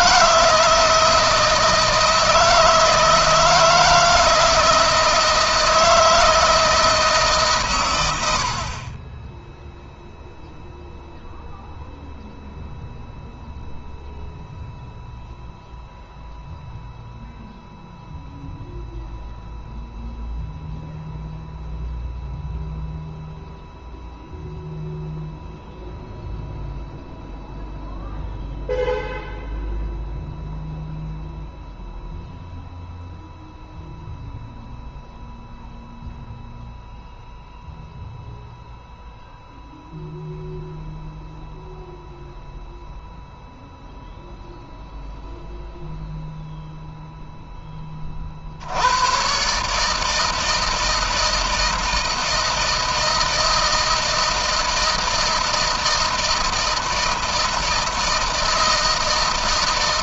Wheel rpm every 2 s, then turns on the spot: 160, 160, 160, 160, 30, 0, 0, 0, 0, 0, 0, 0, 0, 0, 0, 0, 0, 0, 0, 0, 0, 0, 0, 0, 90, 160, 160, 160, 160, 160.
none